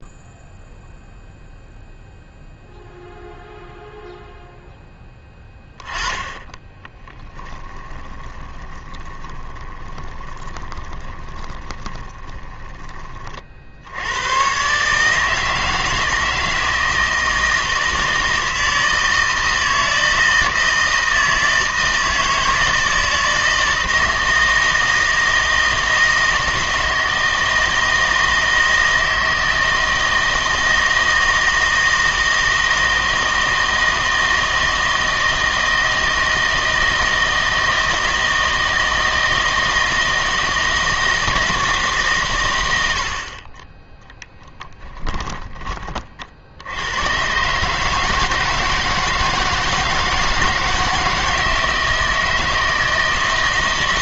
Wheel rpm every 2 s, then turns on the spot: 0, 0, 0, 10, 20, 20, 20, 130, 160, 160, 160, 160, 160, 160, 160, 160, 160, 160, 160, 160, 160, 100, 10, 80, 160, 160, 160.
6-14